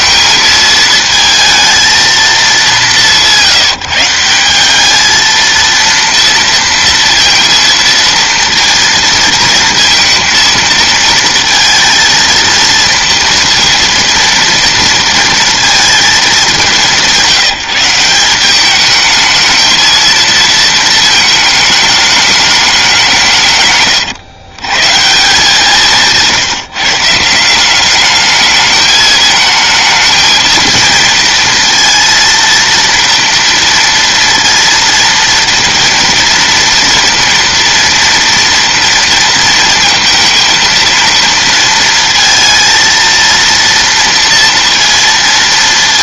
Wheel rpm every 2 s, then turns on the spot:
220, 200, 190, 230, 230, 230, 230, 230, 200, 200, 220, 210, 130, 160, 210, 230, 230, 230, 230, 230, 230, 230, 230.
none